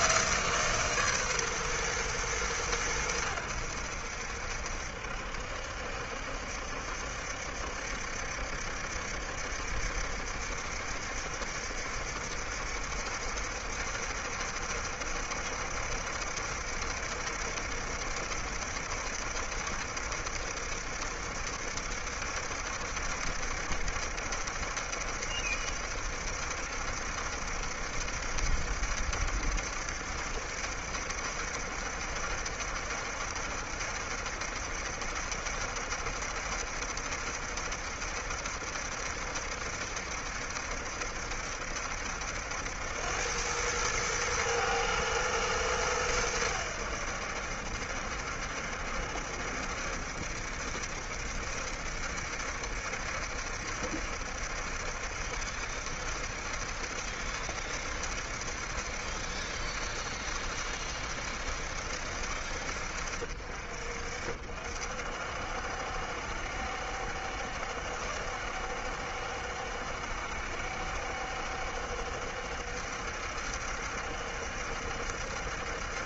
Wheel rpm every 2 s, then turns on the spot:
160, 110, 70, 70, 70, 70, 70, 70, 70, 70, 70, 70, 70, 70, 70, 70, 70, 70, 70, 70, 70, 80, 110, 90, 70, 70, 70, 70, 70, 70, 70, 60, 60, 70, 70, 70, 70, 70.
none